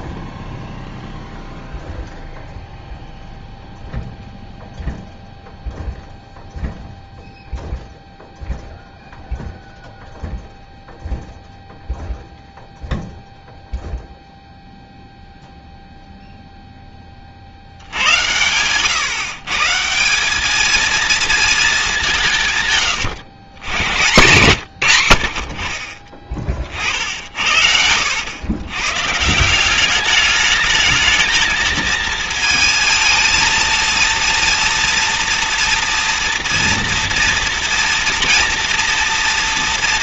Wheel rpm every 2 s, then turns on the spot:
0, 0, 0, 0, 0, 0, 0, 0, 0, 120, 210, 140, 130, 50, 110, 210, 220, 230, 230, 230.
none